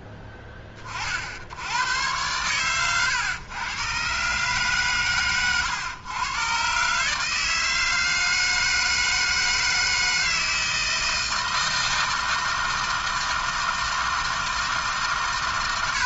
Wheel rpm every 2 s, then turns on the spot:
40, 110, 140, 130, 160, 160, 160, 160.
none